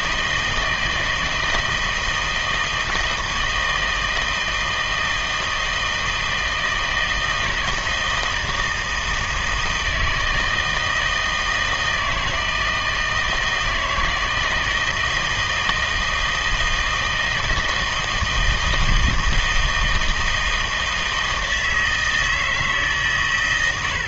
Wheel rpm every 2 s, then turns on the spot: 160, 160, 160, 160, 160, 160, 160, 160, 160, 160, 160, 150.
none